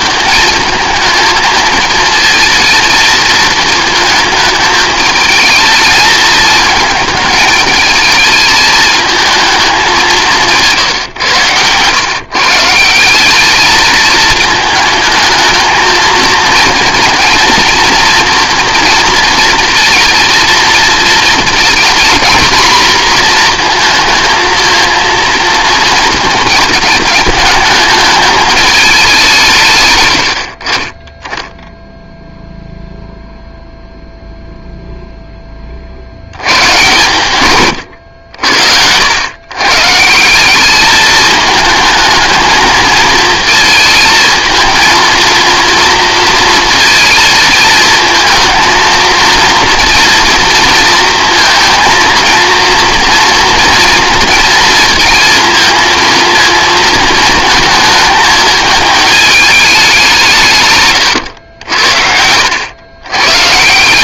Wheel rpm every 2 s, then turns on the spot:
220, 230, 220, 220, 220, 140, 170, 220, 230, 230, 220, 230, 230, 220, 210, 40, 0, 0, 120, 70, 200, 220, 220, 230, 230, 230, 230, 230, 220, 210, 140, 100.
60-62